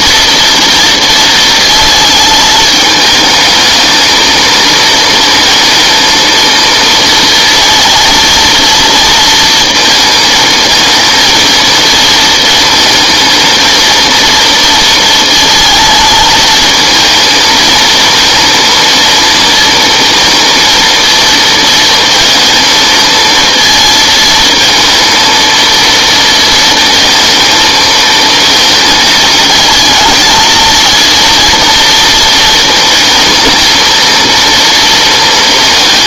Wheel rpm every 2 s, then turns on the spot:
230, 210, 220, 230, 230, 230, 230, 230, 220, 230, 230, 230, 230, 230, 230, 230, 220, 230.
none